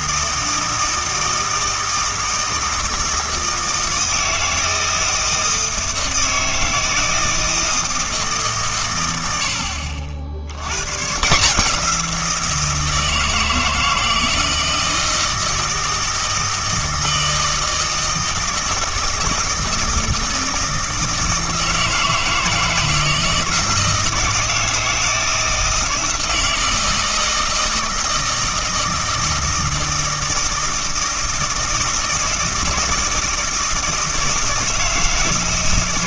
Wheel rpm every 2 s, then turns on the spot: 160, 160, 160, 160, 130, 100, 160, 160, 160, 160, 160, 160, 160, 160, 160, 160, 160, 160.
none